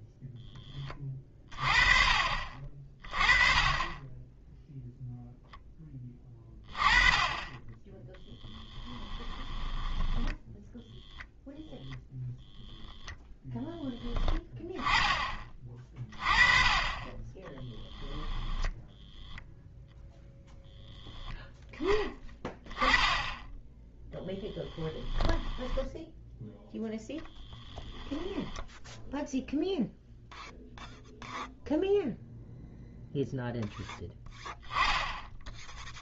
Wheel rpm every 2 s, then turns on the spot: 20, 30, 0, 20, 10, 10, 10, 10, 20, 10, 10, 30, 10, 0, 10, 0, 0, 10.
8-10 24-26